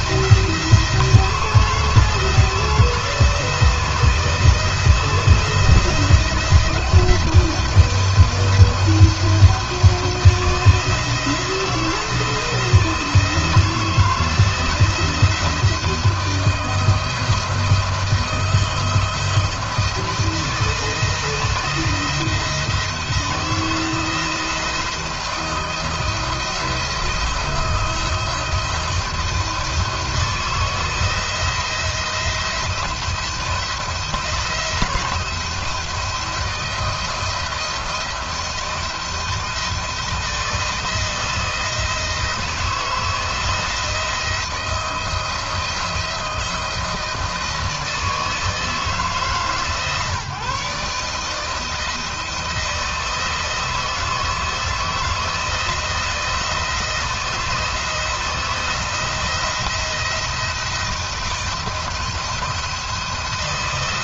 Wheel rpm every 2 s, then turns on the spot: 170, 170, 160, 170, 170, 170, 160, 160, 160, 160, 160, 160, 170, 170, 170, 160, 170, 170, 170, 160, 160, 160, 170, 170, 160, 150, 160, 160, 160, 160, 170, 170.
none